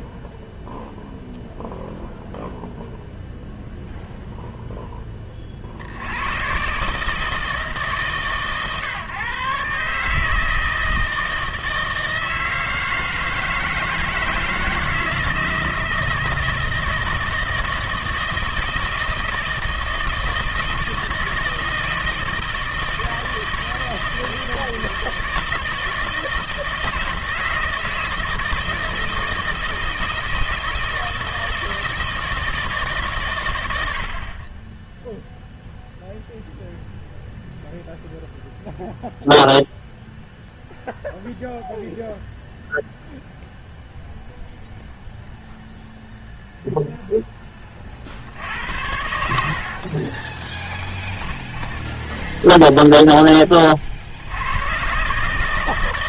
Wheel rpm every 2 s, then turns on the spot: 0, 0, 0, 130, 140, 160, 160, 160, 160, 160, 160, 160, 160, 160, 160, 160, 150, 20, 0, 0, 0, 0, 0, 0, 80, 20, 0, 110.
50-52